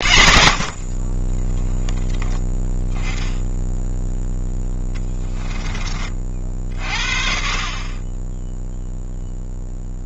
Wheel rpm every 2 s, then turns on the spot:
50, 10, 10, 50, 0.
4-6